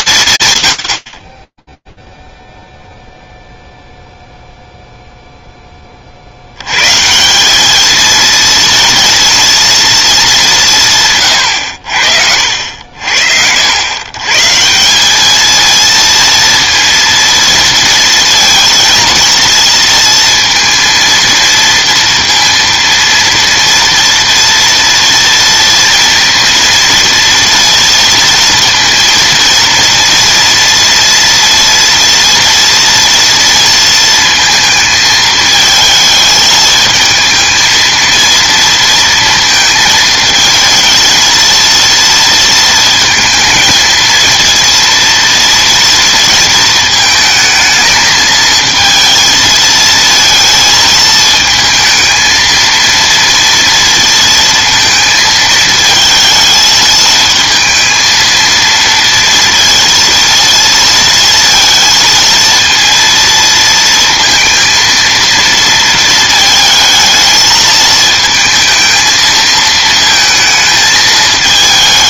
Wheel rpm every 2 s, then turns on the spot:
110, 0, 0, 120, 230, 170, 60, 180, 230, 230, 230, 230, 230, 230, 230, 230, 230, 220, 220, 230, 230, 230, 230, 220, 230, 220, 230, 230, 220, 230, 230, 230, 230, 220, 220, 220.
none